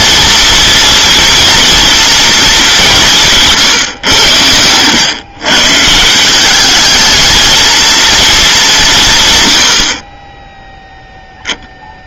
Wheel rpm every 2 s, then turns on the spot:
230, 190, 110, 220, 180, 0.
none